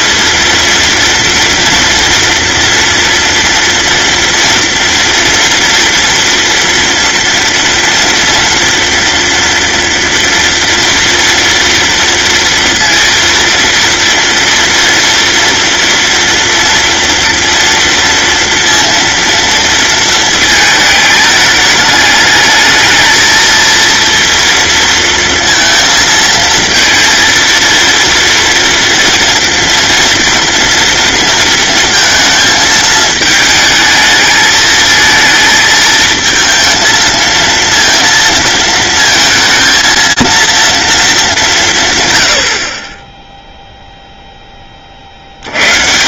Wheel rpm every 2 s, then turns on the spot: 230, 230, 230, 230, 230, 230, 230, 230, 230, 230, 220, 220, 230, 230, 240, 230, 220, 220, 220, 220, 230, 30, 30.
none